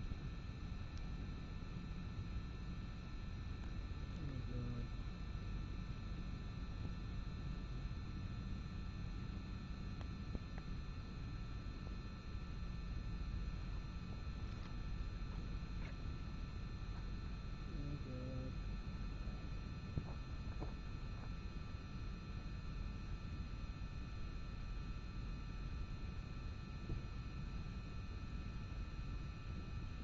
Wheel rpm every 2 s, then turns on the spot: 0, 0, 0, 0, 0, 0, 0, 0, 0, 0, 0, 0, 0, 0, 0.
none